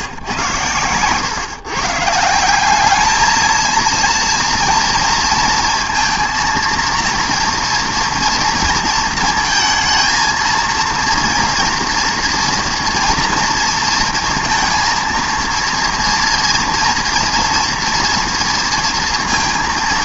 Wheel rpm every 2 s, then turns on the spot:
110, 190, 230, 230, 230, 230, 240, 230, 230, 230.
none